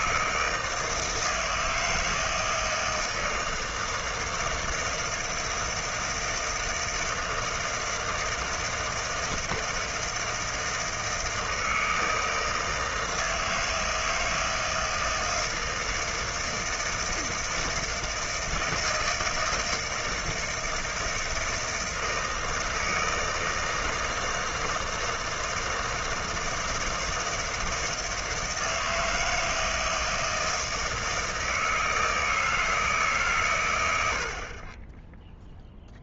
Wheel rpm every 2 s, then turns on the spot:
160, 160, 160, 160, 160, 160, 160, 160, 160, 160, 160, 160, 160, 160, 160, 160, 160, 30.
none